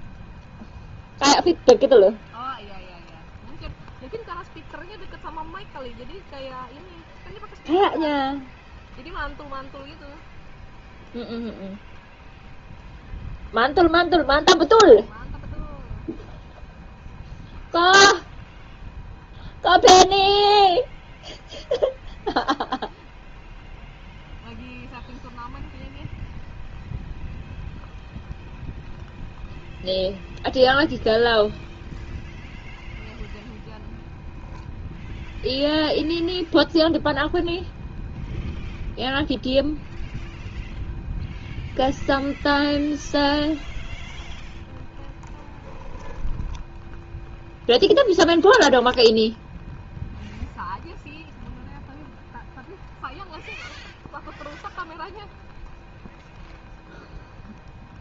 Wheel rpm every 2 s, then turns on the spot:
0, 0, 0, 0, 0, 0, 0, 0, 0, 0, 0, 0, 0, 0, 0, 0, 0, 0, 0, 0, 0, 0, 0, 0, 0, 0, 0, 0, 0.
none